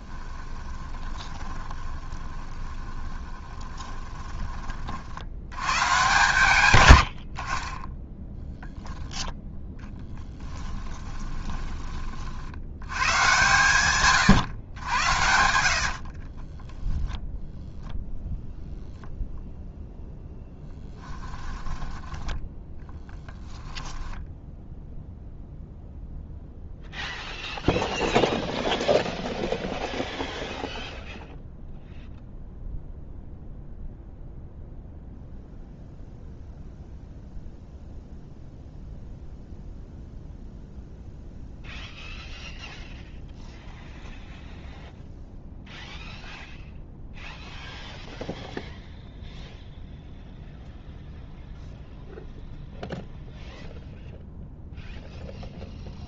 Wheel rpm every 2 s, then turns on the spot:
20, 20, 30, 120, 0, 10, 80, 110, 10, 0, 10, 10, 0, 0, 0, 0, 0, 0, 0, 0, 0, 0, 0, 0, 0, 0, 0, 0.
0-4 10-12 14-18